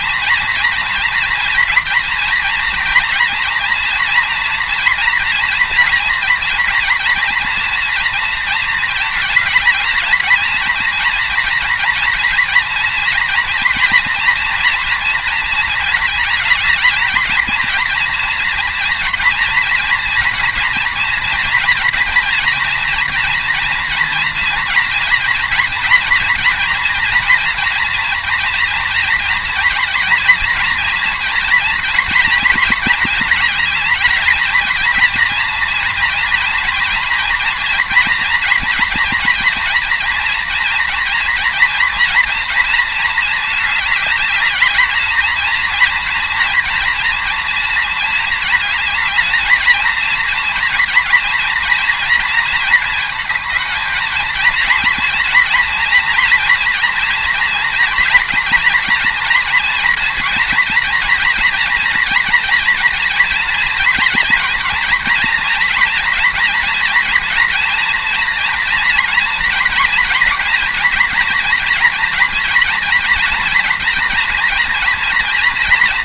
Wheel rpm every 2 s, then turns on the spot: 230, 230, 230, 230, 220, 230, 240, 230, 220, 240, 240, 230, 230, 230, 230, 240, 230, 230, 230, 240, 230, 230, 210, 230, 220, 230, 230, 230, 230, 230, 230, 230, 230, 230, 230, 230, 230, 230.
none